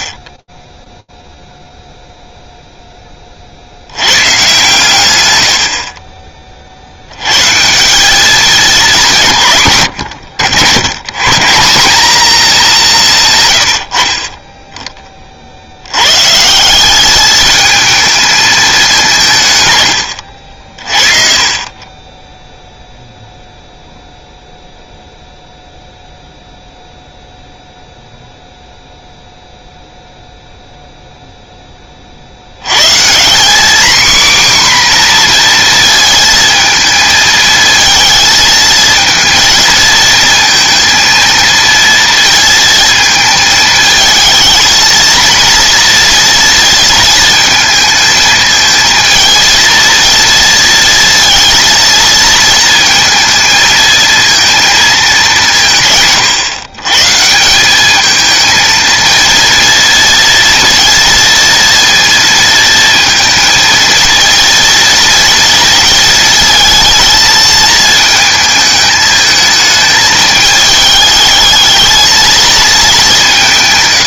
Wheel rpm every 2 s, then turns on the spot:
10, 0, 130, 60, 200, 120, 200, 20, 200, 190, 40, 0, 0, 0, 0, 0, 150, 250, 220, 220, 220, 220, 230, 230, 220, 230, 230, 220, 140, 220, 230, 230, 230, 230, 220, 210, 200.
none